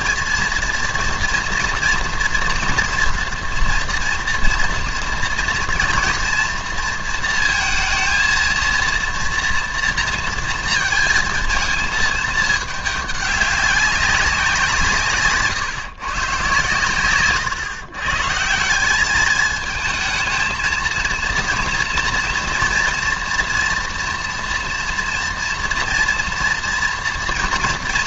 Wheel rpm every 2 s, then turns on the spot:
230, 230, 230, 230, 230, 230, 210, 170, 120, 170, 230, 230, 230, 240.
none